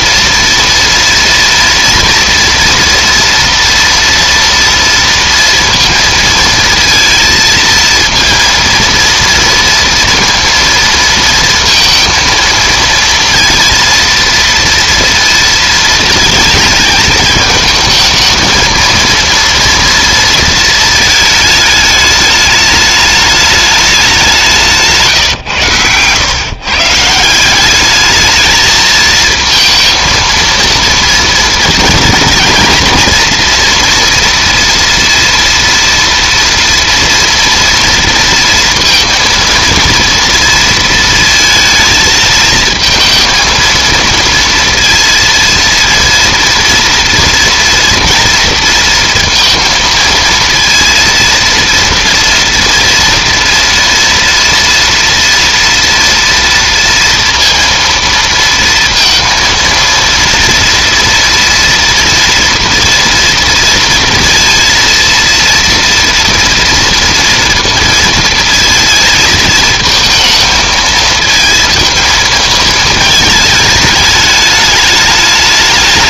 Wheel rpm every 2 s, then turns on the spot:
230, 230, 230, 230, 230, 230, 230, 230, 220, 230, 220, 210, 150, 150, 220, 230, 240, 230, 230, 230, 230, 220, 230, 230, 230, 230, 230, 230, 230, 230, 230, 230, 230, 230, 220, 220, 220, 210.
none